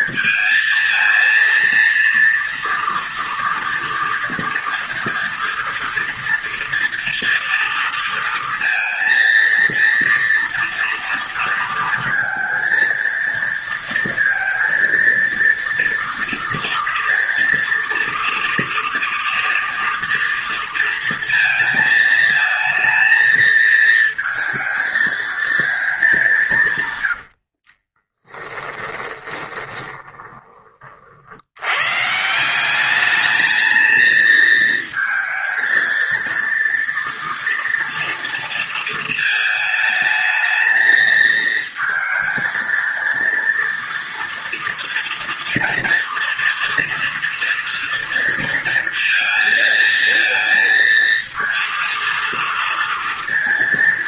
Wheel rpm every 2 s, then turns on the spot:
230, 230, 230, 230, 230, 230, 230, 230, 230, 230, 230, 220, 230, 130, 10, 40, 200, 220, 230, 230, 220, 230, 230, 230, 230, 230, 230.
26-30